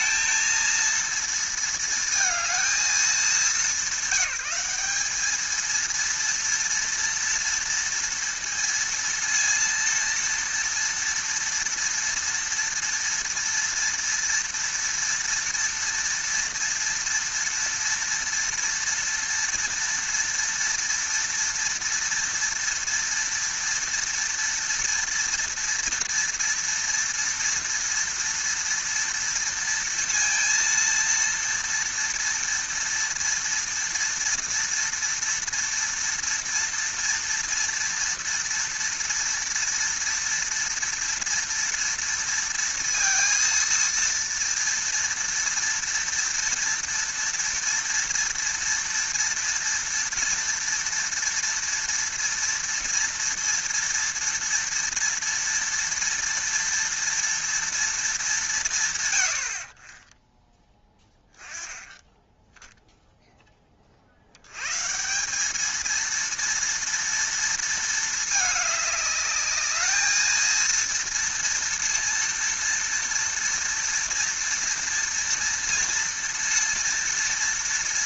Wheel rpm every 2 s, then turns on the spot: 230, 220, 200, 230, 230, 230, 240, 230, 230, 230, 230, 230, 230, 230, 230, 230, 230, 230, 230, 230, 230, 230, 230, 230, 230, 230, 230, 240, 230, 180, 10, 10, 120, 230, 210, 230, 230, 230, 230.
none